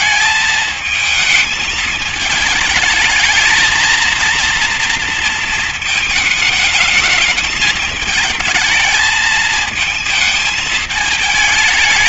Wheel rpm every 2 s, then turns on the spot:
220, 220, 230, 220, 220, 220.
none